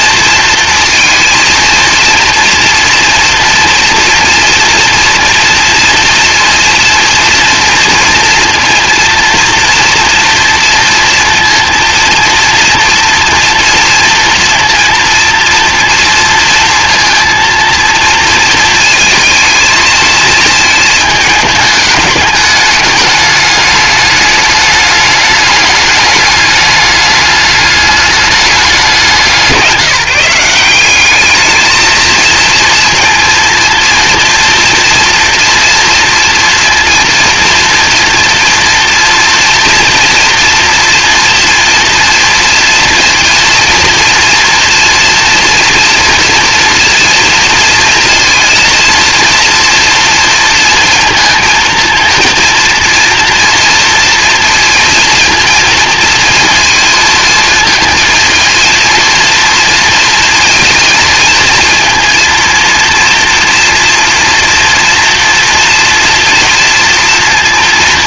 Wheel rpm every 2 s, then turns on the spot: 230, 230, 230, 230, 230, 230, 230, 230, 230, 230, 220, 210, 210, 210, 200, 180, 230, 240, 230, 230, 230, 230, 230, 230, 230, 230, 230, 230, 230, 230, 230, 230, 230, 230.
none